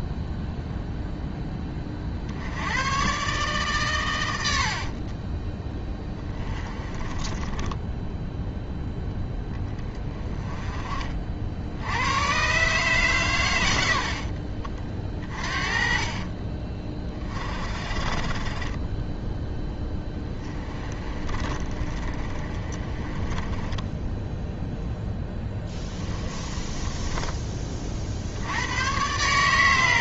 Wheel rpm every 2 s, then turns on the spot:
0, 110, 50, 20, 0, 30, 140, 40, 30, 20, 20, 20, 0, 20, 110.
4-8 18-24 26-28